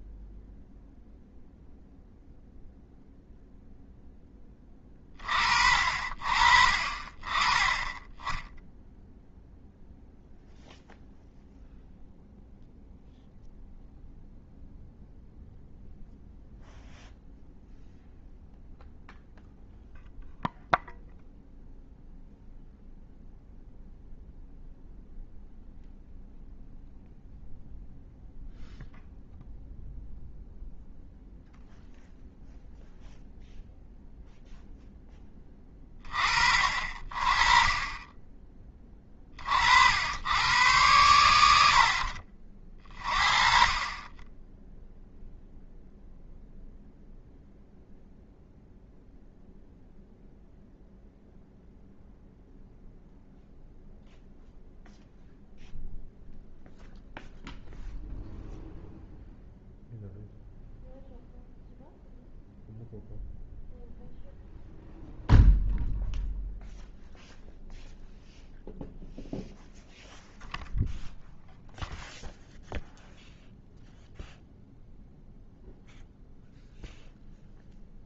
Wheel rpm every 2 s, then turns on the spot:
0, 0, 20, 40, 0, 0, 0, 0, 0, 0, 0, 0, 0, 0, 0, 0, 0, 0, 40, 20, 100, 30, 0, 0, 0, 0, 0, 0, 0, 0, 0, 0, 0, 0, 0, 0, 0, 0, 0.
none